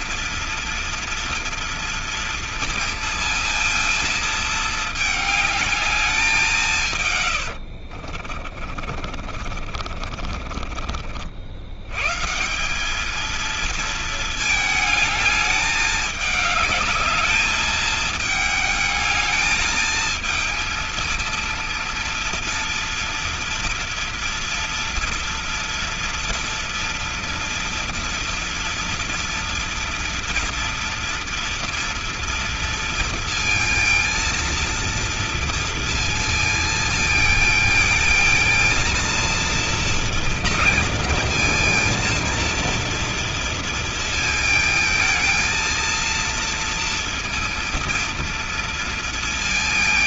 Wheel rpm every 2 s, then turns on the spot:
230, 230, 220, 160, 40, 40, 190, 220, 210, 220, 230, 240, 230, 230, 230, 230, 230, 230, 220, 230, 230, 230, 220, 230, 230.
8-10